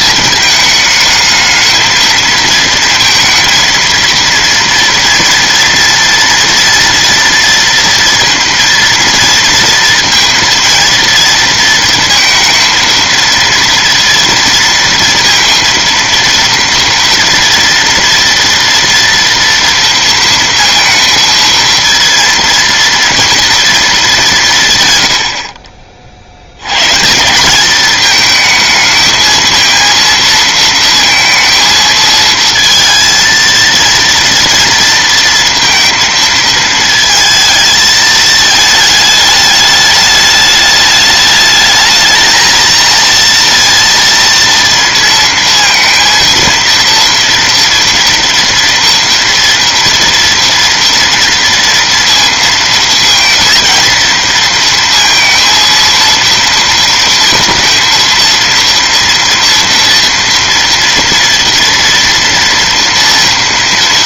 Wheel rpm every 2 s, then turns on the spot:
220, 220, 230, 230, 230, 230, 230, 230, 230, 230, 230, 230, 140, 110, 220, 230, 230, 230, 220, 220, 210, 220, 230, 230, 230, 230, 230, 230, 230, 230, 230, 230.
none